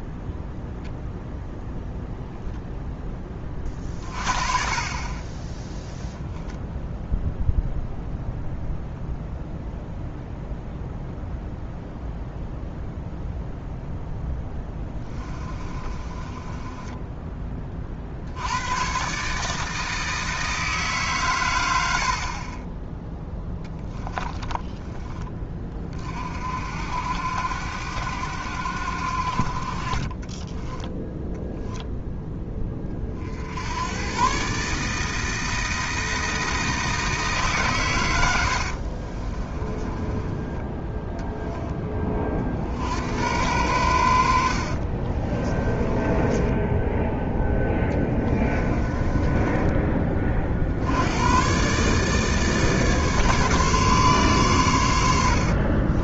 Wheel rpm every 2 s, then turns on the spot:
0, 10, 30, 0, 0, 0, 0, 10, 20, 120, 150, 10, 10, 70, 70, 10, 30, 150, 160, 60, 10, 70, 50, 10, 20, 60, 150, 100.
14-18 30-32 38-40 44-50